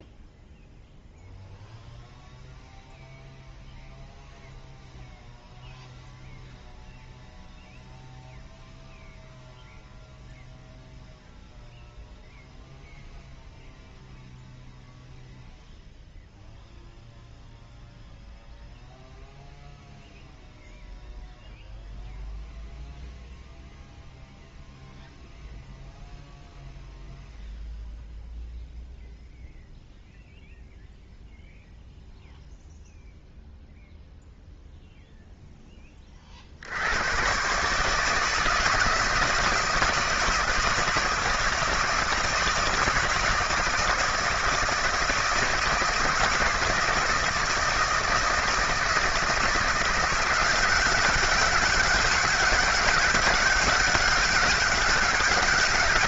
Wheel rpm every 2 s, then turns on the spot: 0, 0, 0, 0, 0, 0, 0, 0, 0, 0, 0, 0, 0, 0, 0, 0, 0, 0, 60, 160, 160, 160, 160, 150, 160, 180, 190, 190.
none